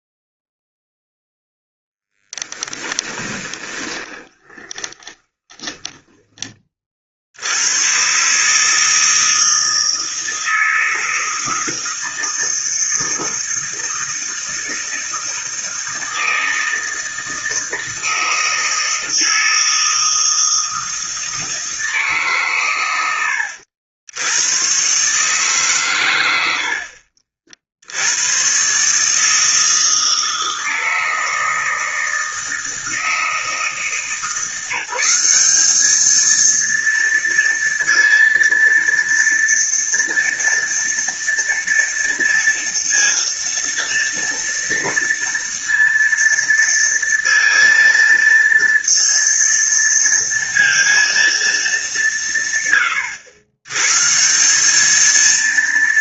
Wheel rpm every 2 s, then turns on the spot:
0, 20, 20, 20, 150, 160, 160, 160, 160, 160, 160, 130, 110, 80, 120, 160, 160, 170, 230, 230, 230, 230, 230, 230, 230, 230, 150, 190.
2-6